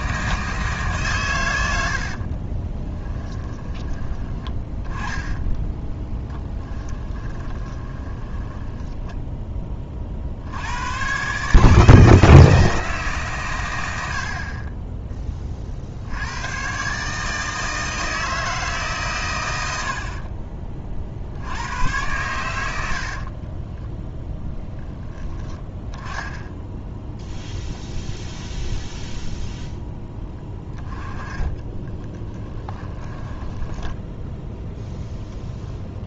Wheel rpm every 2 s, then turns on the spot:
150, 20, 20, 10, 10, 90, 160, 30, 120, 150, 40, 90, 10, 0, 0, 10, 20, 0.
2-10 22-24 30-34